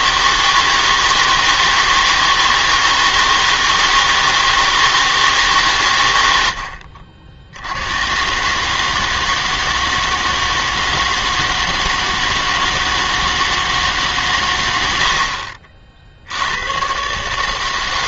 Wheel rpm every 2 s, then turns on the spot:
160, 160, 160, 80, 150, 160, 160, 100, 100.
none